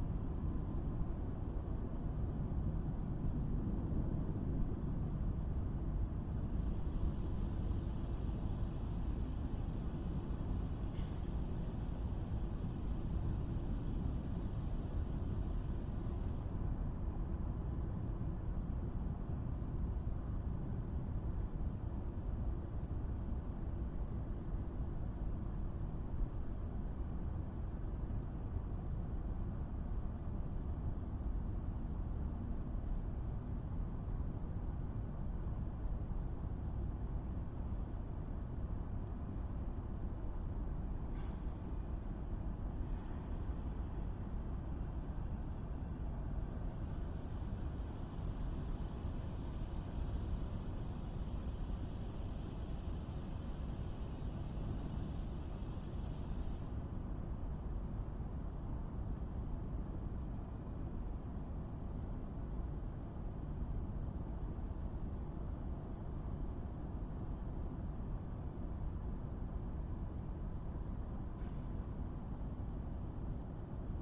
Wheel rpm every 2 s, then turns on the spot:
0, 0, 0, 0, 0, 0, 0, 0, 0, 0, 0, 0, 0, 0, 0, 0, 0, 0, 0, 0, 0, 0, 0, 0, 0, 0, 0, 0, 0, 0, 0, 0, 0, 0, 0, 0, 0.
none